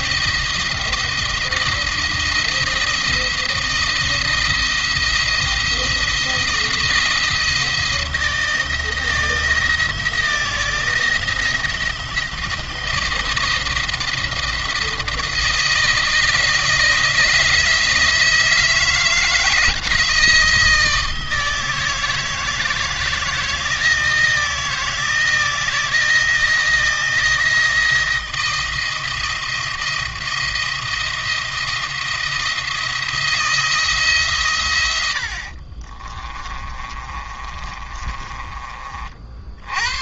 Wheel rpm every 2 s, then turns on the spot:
170, 170, 170, 170, 160, 170, 170, 170, 170, 170, 160, 160, 160, 170, 170, 170, 160, 110, 30, 30.
36-38